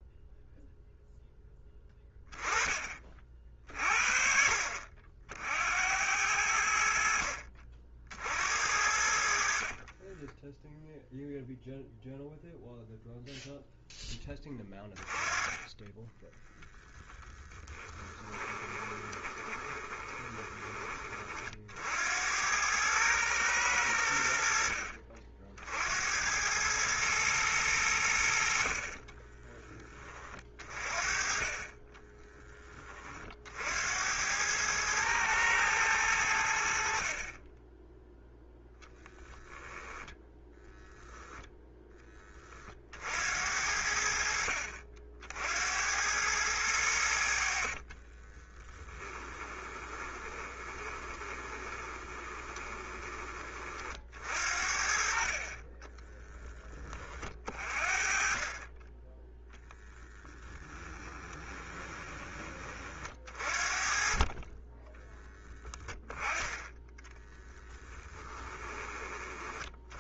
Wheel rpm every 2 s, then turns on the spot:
0, 20, 60, 80, 70, 10, 0, 20, 10, 20, 20, 90, 60, 110, 50, 30, 20, 100, 70, 10, 0, 30, 60, 100, 20, 20, 20, 60, 10, 30, 10, 30, 20, 10, 10.
10-12 16-20 48-54 60-62 64-66 68-70